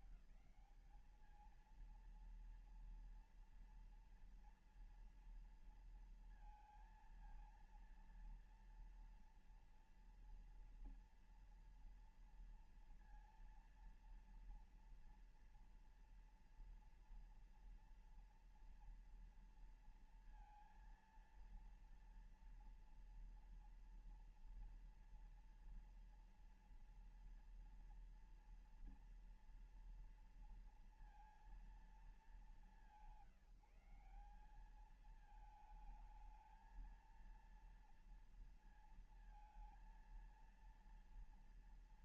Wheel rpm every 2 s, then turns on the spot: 180, 230, 230, 230, 230, 230, 230, 230, 230, 230, 230, 230, 230, 240, 230, 230, 200, 190, 220, 230, 230.
none